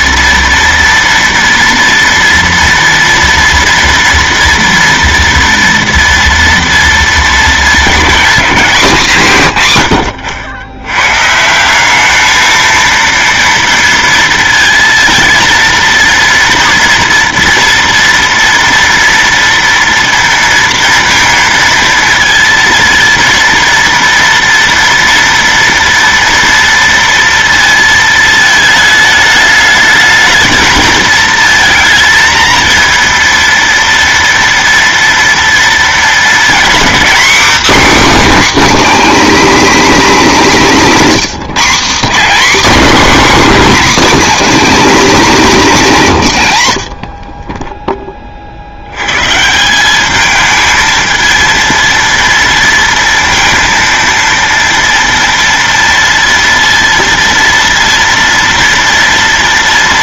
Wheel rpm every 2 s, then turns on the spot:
230, 230, 230, 230, 200, 100, 220, 230, 230, 230, 230, 230, 230, 230, 220, 220, 230, 230, 240, 290, 240, 270, 270, 120, 60, 220, 230, 230, 230, 230.
none